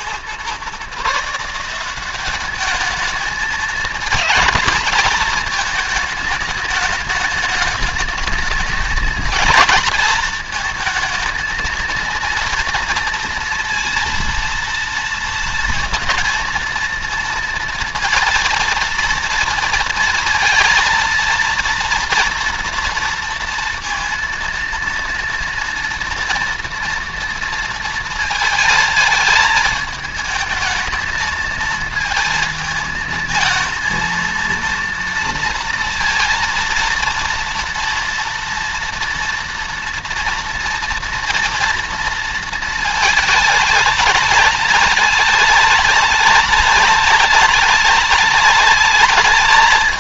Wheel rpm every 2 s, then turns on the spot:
140, 210, 230, 210, 220, 220, 230, 230, 230, 230, 230, 230, 230, 230, 220, 220, 220, 230, 230, 230, 240, 230, 210, 210, 210.
none